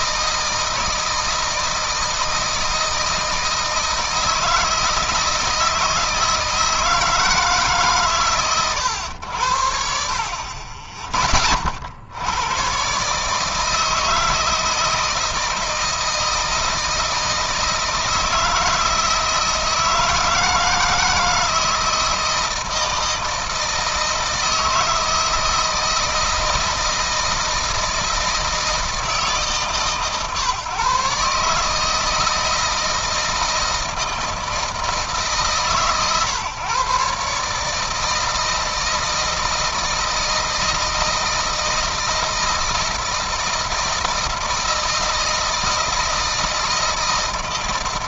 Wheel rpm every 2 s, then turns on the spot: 160, 160, 160, 160, 110, 40, 120, 160, 160, 160, 160, 160, 160, 160, 160, 140, 160, 160, 140, 160, 160, 160, 160, 160.
none